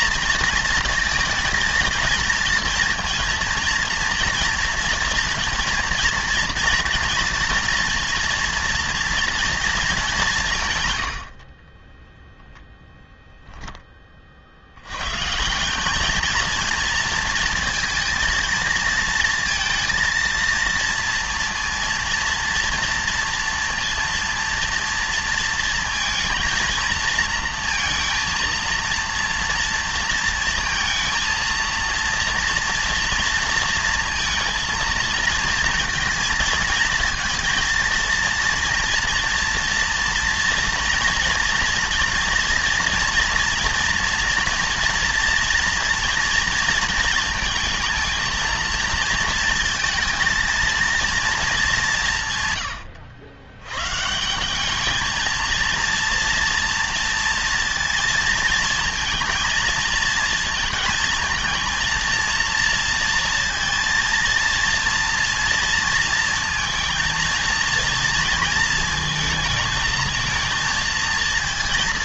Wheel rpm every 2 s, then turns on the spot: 230, 230, 230, 230, 230, 120, 10, 90, 230, 230, 230, 230, 230, 230, 230, 230, 230, 230, 230, 230, 230, 230, 230, 230, 230, 230, 120, 210, 230, 230, 230, 230, 230, 230, 220, 220.
none